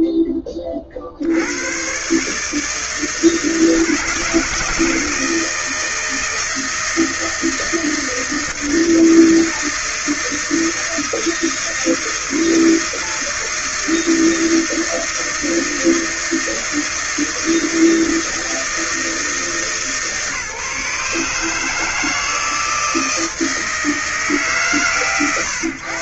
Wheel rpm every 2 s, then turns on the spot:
20, 150, 160, 160, 160, 160, 160, 160, 160, 160, 150, 160, 140.
none